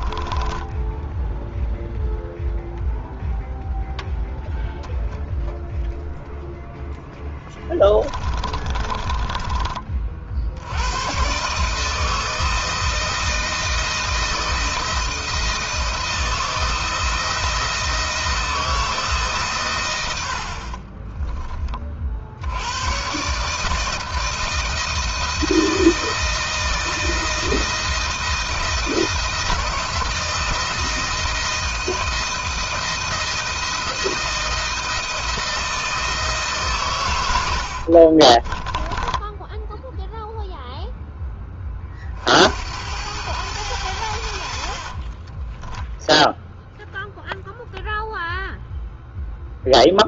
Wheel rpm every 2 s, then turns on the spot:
10, 0, 0, 0, 30, 80, 160, 170, 160, 160, 40, 100, 160, 160, 160, 160, 160, 170, 130, 10, 0, 80, 60, 0, 0.
0-2 8-10 20-22 38-40 44-46